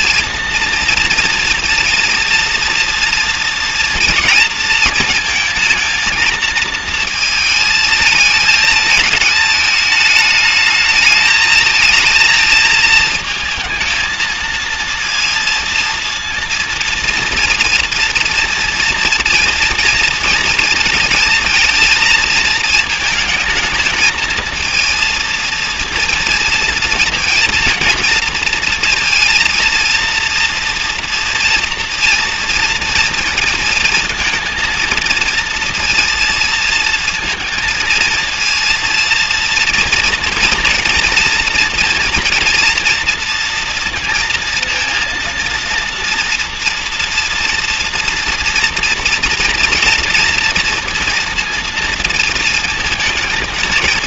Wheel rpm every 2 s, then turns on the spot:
230, 230, 230, 230, 220, 210, 220, 230, 230, 230, 230, 220, 230, 230, 230, 230, 230, 230, 230, 230, 230, 230, 230, 240, 230, 230, 220.
none